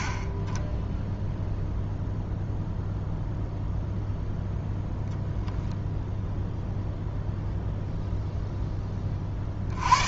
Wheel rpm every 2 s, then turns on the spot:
10, 0, 0, 0, 10.
none